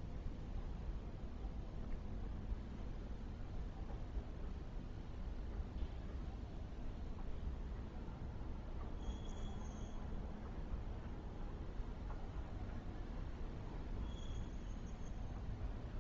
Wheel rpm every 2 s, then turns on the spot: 0, 0, 0, 0, 0, 0, 0, 0.
none